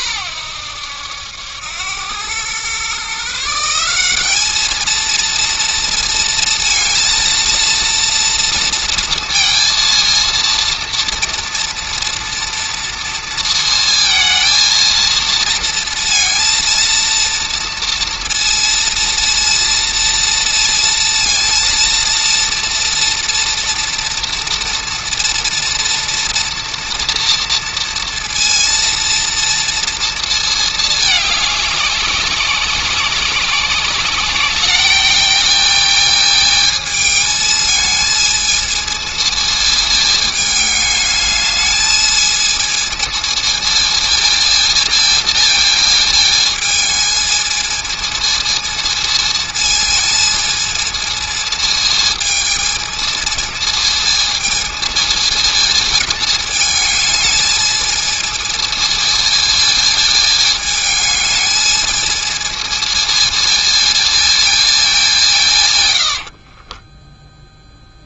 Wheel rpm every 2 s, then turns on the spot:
90, 130, 220, 230, 230, 230, 230, 230, 230, 230, 230, 230, 230, 230, 230, 210, 190, 210, 220, 220, 210, 220, 230, 220, 220, 230, 220, 220, 220, 220, 210, 220, 210, 20.
66-68